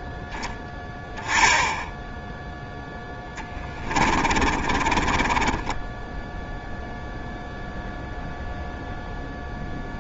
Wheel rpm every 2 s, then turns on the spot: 10, 10, 30, 0, 0.
4-6